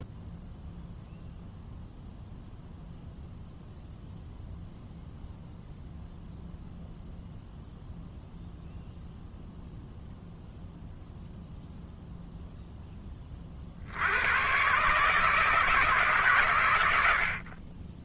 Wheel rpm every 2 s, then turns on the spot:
0, 0, 0, 0, 0, 0, 0, 120, 110.
none